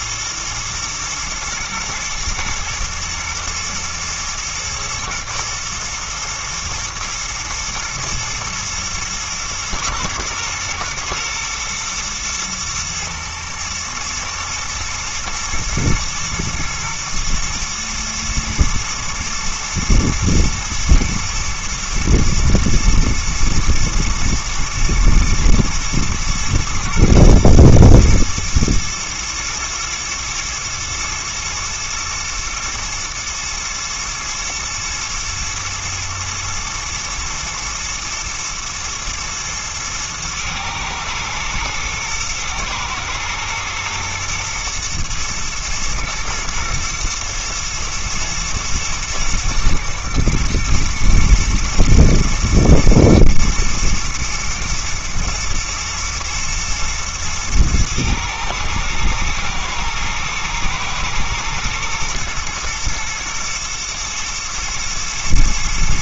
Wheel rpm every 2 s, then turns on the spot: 110, 110, 120, 110, 110, 120, 110, 120, 120, 110, 120, 120, 110, 110, 110, 110, 120, 110, 110, 110, 110, 120, 120, 120, 120, 120, 110, 110, 120, 120, 110, 110, 110.
none